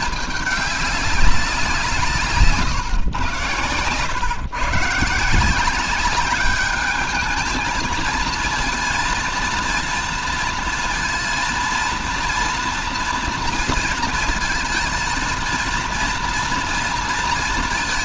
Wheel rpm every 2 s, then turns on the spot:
200, 130, 130, 210, 230, 230, 230, 230, 230.
none